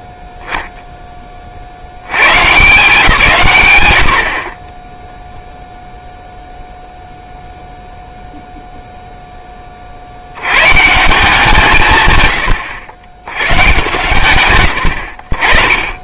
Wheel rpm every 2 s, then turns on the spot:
10, 160, 40, 0, 0, 150, 80, 130.
none